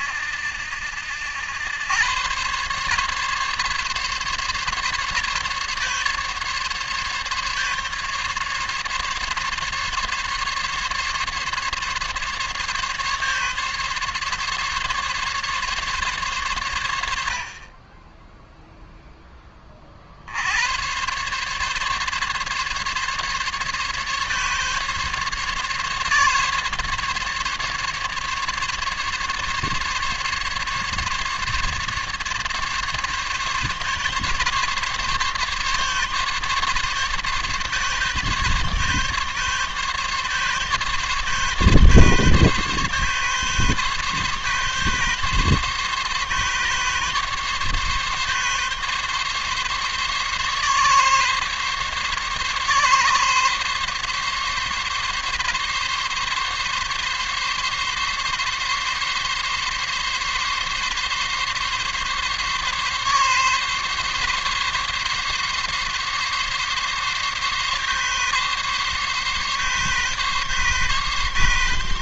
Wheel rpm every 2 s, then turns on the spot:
80, 130, 140, 140, 140, 140, 140, 140, 100, 0, 110, 140, 140, 140, 140, 140, 140, 140, 140, 140, 140, 140, 140, 140, 140, 140, 140, 140, 140, 140, 140, 140, 140, 140, 140, 140.
none